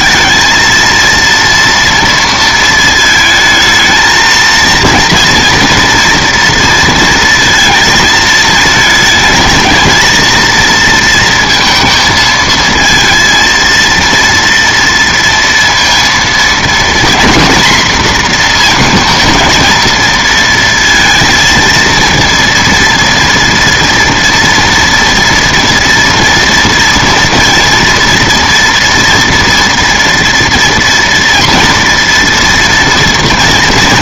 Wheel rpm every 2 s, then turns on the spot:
220, 230, 230, 230, 220, 230, 230, 230, 230, 230, 230, 230, 230, 230, 230, 230, 240.
none